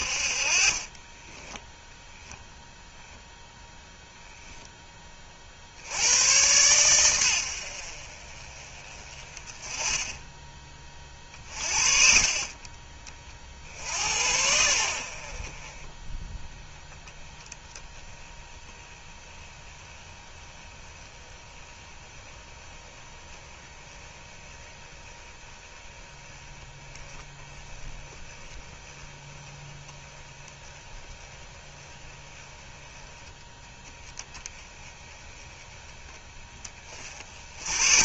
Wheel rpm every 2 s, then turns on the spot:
30, 0, 0, 110, 30, 20, 30, 70, 10, 10, 10, 10, 10, 10, 10, 10, 10, 10, 30.
0-2